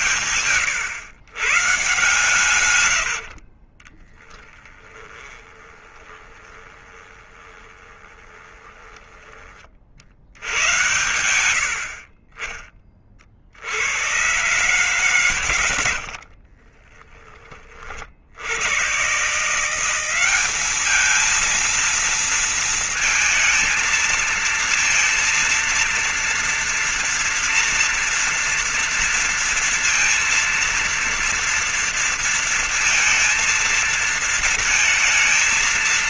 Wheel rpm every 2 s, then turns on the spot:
120, 130, 20, 20, 20, 60, 50, 100, 60, 50, 180, 230, 220, 230, 230, 230, 230, 230.
2-10 16-18